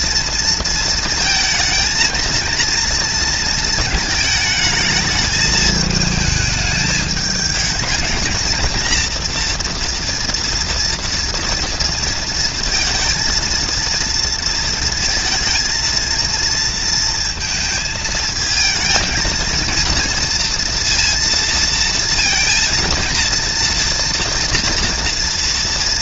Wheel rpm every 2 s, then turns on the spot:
230, 230, 220, 210, 240, 230, 230, 230, 230, 230, 230, 230, 230.
none